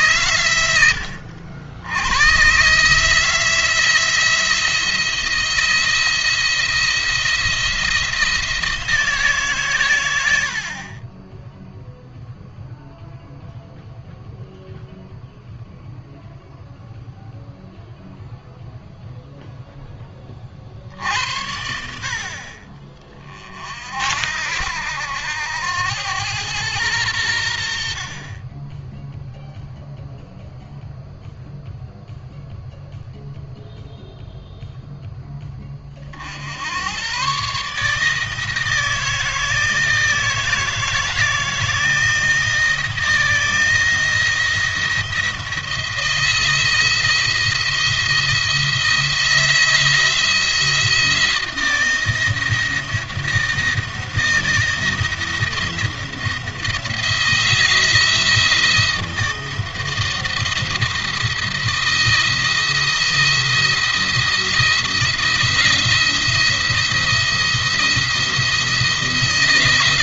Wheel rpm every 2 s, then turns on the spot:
80, 170, 170, 170, 130, 0, 0, 0, 0, 0, 70, 40, 80, 80, 0, 0, 0, 10, 120, 160, 160, 170, 170, 170, 170, 160, 160, 170, 160, 160, 160, 170, 170, 170, 160.
none